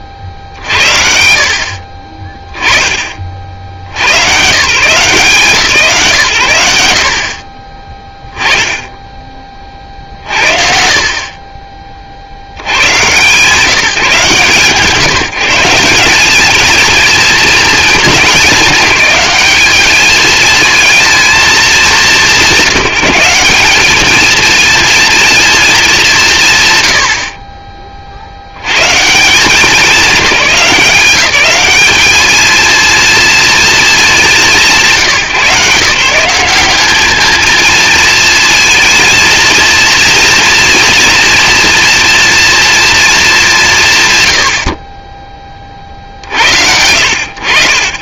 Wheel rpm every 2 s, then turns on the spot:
50, 20, 140, 70, 10, 60, 90, 150, 220, 210, 220, 180, 230, 110, 130, 190, 220, 180, 190, 230, 230, 220, 20, 80.
none